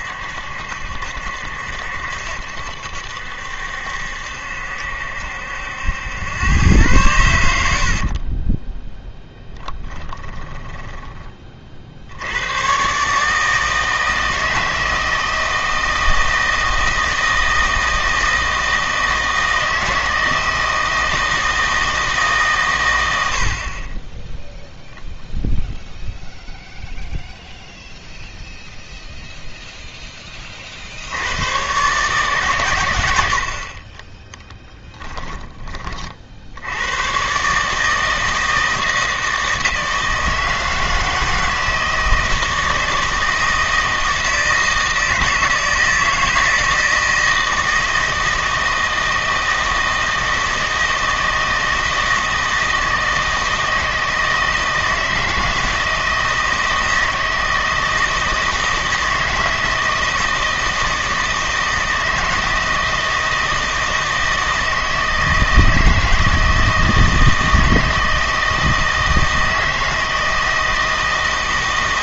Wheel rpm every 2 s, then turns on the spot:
70, 70, 70, 110, 20, 10, 110, 160, 160, 160, 160, 130, 0, 0, 0, 50, 110, 10, 80, 160, 160, 160, 160, 160, 160, 160, 160, 160, 160, 160, 160, 160, 160, 160, 160, 160.
8-12 34-36